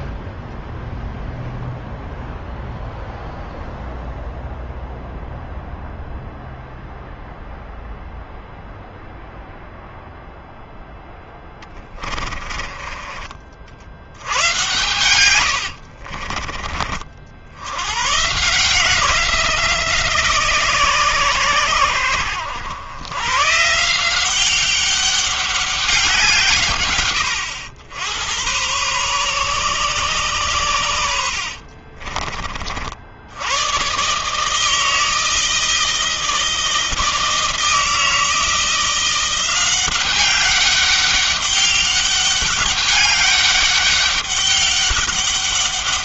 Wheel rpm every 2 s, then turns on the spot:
0, 0, 0, 0, 0, 0, 30, 100, 50, 130, 150, 90, 180, 160, 100, 120, 40, 140, 160, 160, 190, 200, 200.
12-14 16-18